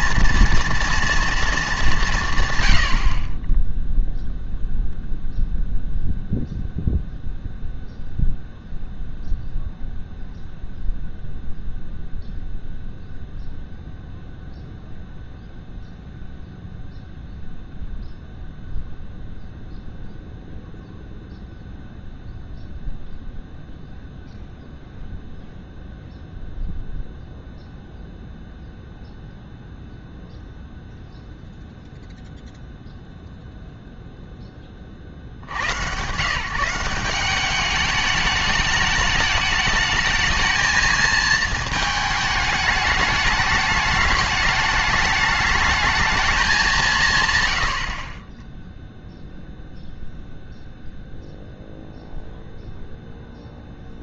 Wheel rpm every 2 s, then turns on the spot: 230, 110, 0, 0, 0, 0, 0, 0, 0, 0, 0, 0, 0, 0, 0, 0, 0, 30, 170, 210, 220, 210, 210, 190, 10, 0, 0.
none